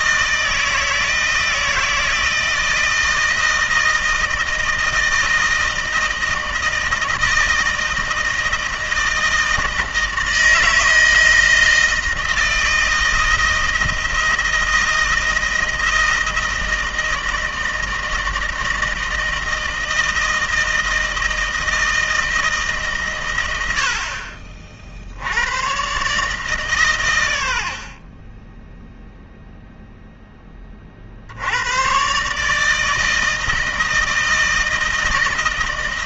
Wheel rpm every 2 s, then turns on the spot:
160, 160, 160, 160, 160, 160, 160, 160, 160, 160, 160, 150, 50, 140, 10, 20, 140, 160.
none